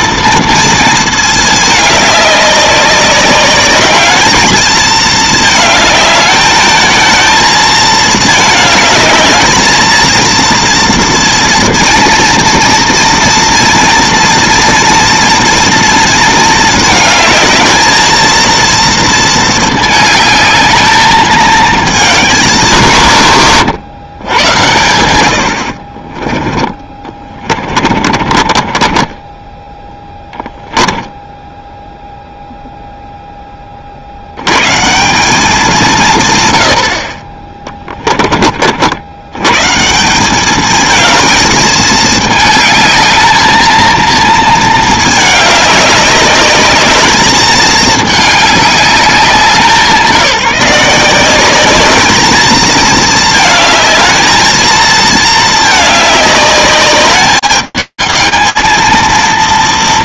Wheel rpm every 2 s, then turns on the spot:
230, 200, 220, 220, 220, 230, 230, 230, 220, 230, 210, 180, 90, 20, 40, 10, 0, 130, 80, 60, 210, 220, 220, 210, 210, 170, 220, 220, 200, 200.
26-30